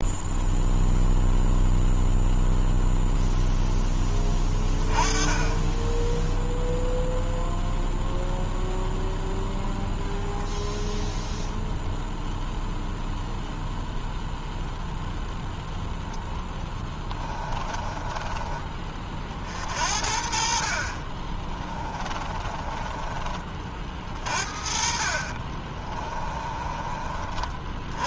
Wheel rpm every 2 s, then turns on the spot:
0, 0, 20, 0, 0, 0, 0, 0, 20, 30, 40, 20, 50, 30.
16-18 22-26